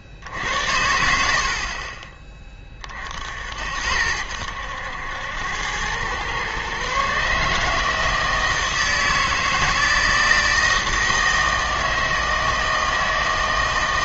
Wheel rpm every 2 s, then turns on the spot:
80, 30, 90, 130, 160, 160, 160.
none